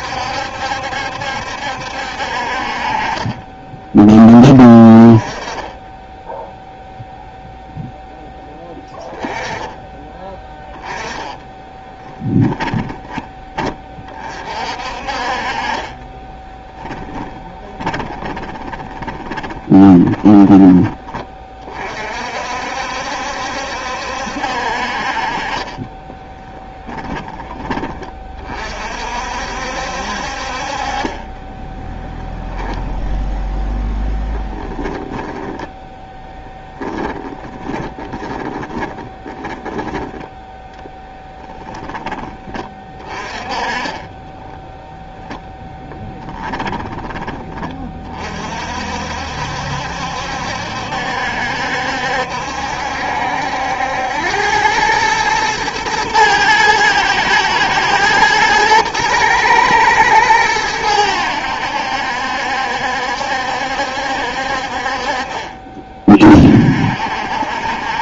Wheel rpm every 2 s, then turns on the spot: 70, 40, 20, 0, 10, 10, 10, 40, 10, 20, 10, 60, 50, 10, 40, 40, 10, 20, 10, 20, 10, 30, 20, 20, 50, 70, 70, 100, 110, 110, 100, 70, 50, 50.
12-14 16-20 34-40 44-48